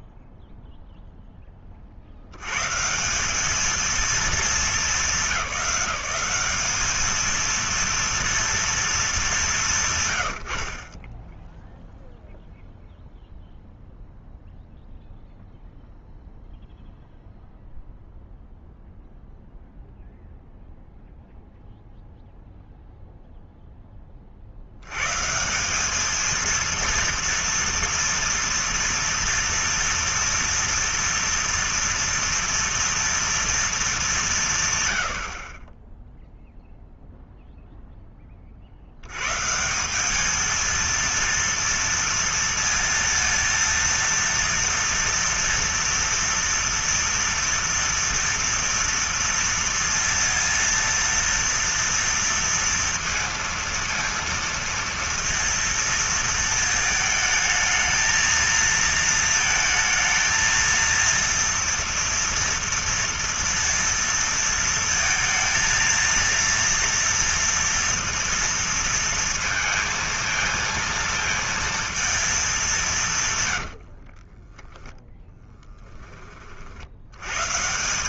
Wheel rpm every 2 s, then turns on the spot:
0, 110, 210, 200, 230, 60, 0, 0, 0, 0, 0, 0, 70, 230, 230, 240, 230, 150, 0, 50, 220, 230, 230, 230, 230, 230, 230, 230, 220, 220, 230, 230, 230, 230, 230, 230, 210, 20, 50.
74-76